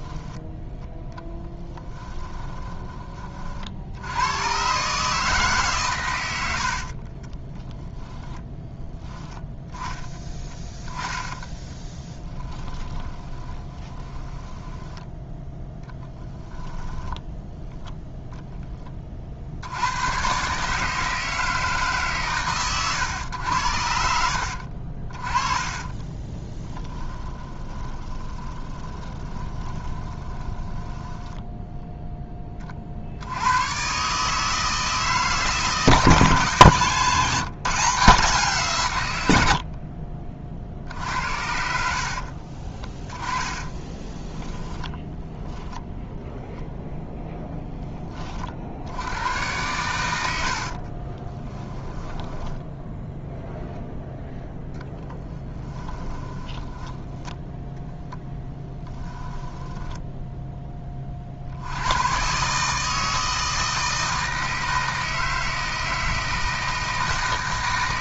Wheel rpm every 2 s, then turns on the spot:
10, 20, 130, 50, 10, 10, 20, 10, 10, 30, 150, 120, 50, 10, 20, 10, 50, 160, 160, 140, 60, 20, 10, 0, 70, 50, 0, 0, 20, 10, 20, 150, 160, 160.
2-4 6-8 10-18 24-32 36-38 40-46 50-52 56-60